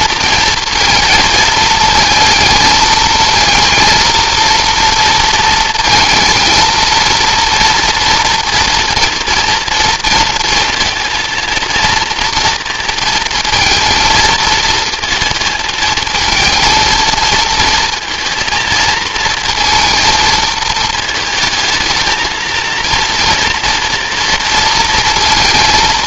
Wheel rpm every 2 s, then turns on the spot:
230, 220, 230, 230, 230, 230, 230, 220, 230, 230, 230, 230, 230.
none